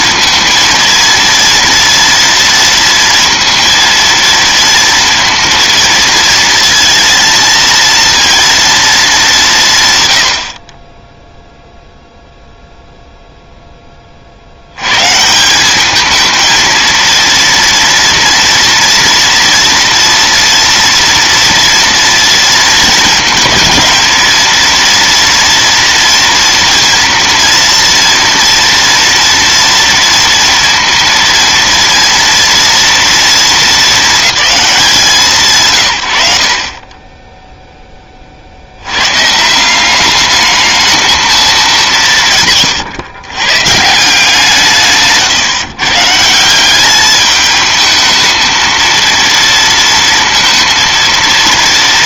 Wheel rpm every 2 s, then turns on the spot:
230, 230, 230, 230, 140, 0, 0, 180, 230, 230, 230, 230, 230, 230, 230, 230, 220, 170, 10, 120, 220, 120, 140, 210, 230, 230.
none